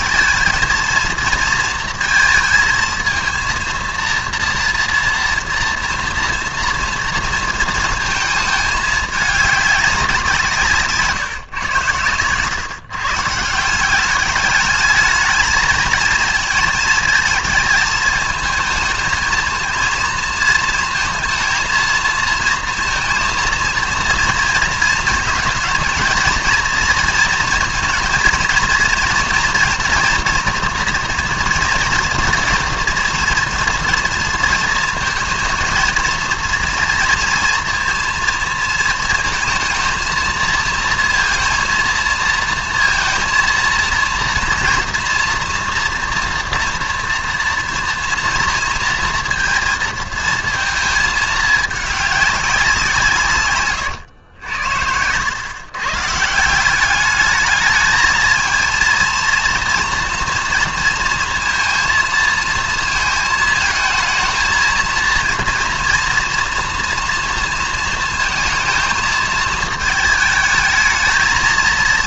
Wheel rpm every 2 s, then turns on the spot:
230, 230, 230, 230, 220, 160, 130, 210, 220, 220, 230, 230, 230, 230, 230, 230, 230, 230, 240, 230, 230, 230, 230, 230, 230, 220, 190, 90, 190, 220, 230, 220, 230, 240, 220, 220.
54-56